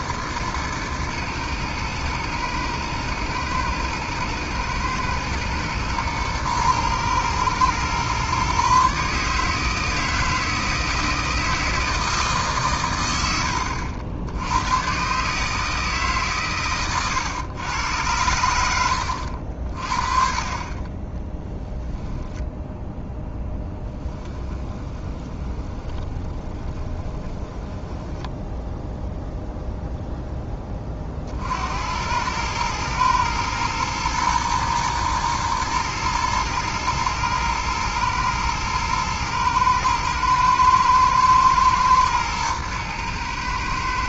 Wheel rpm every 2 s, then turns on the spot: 120, 110, 110, 110, 130, 160, 140, 100, 130, 80, 30, 0, 20, 20, 0, 20, 110, 120, 110, 110, 110, 110.
24-28